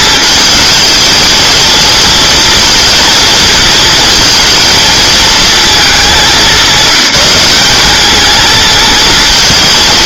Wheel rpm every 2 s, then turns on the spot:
220, 230, 230, 200, 230.
none